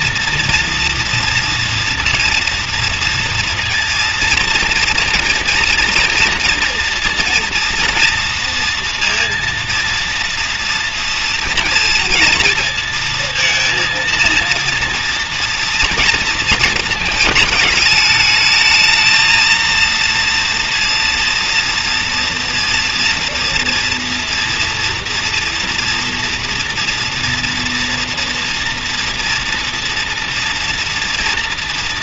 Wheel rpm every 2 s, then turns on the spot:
230, 230, 230, 230, 230, 230, 230, 230, 230, 220, 230, 230, 230, 230, 230, 230.
none